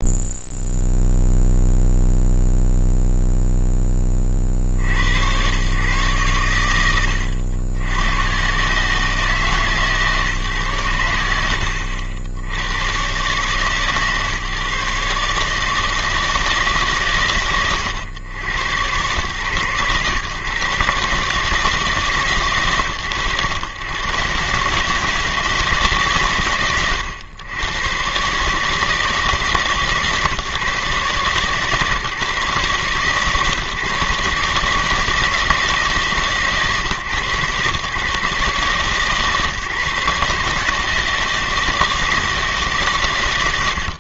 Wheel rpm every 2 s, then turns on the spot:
0, 0, 50, 80, 120, 130, 70, 140, 150, 100, 120, 120, 120, 110, 140, 140, 140, 150, 150, 130, 150, 150.
none